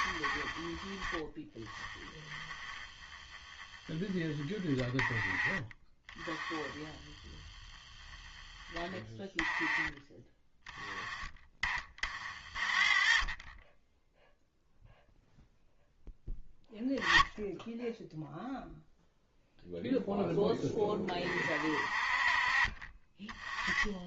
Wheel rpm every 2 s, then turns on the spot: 10, 10, 10, 20, 10, 10, 30, 0, 10, 0, 20, 40.
none